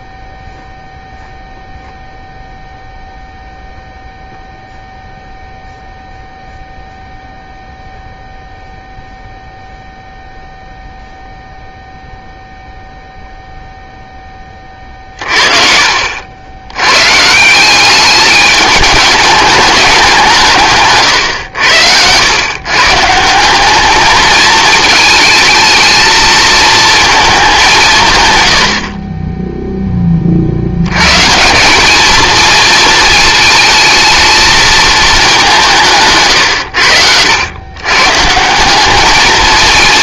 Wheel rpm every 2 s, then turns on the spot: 0, 0, 0, 0, 0, 0, 0, 40, 100, 210, 150, 130, 220, 220, 60, 90, 230, 220, 100, 190.
none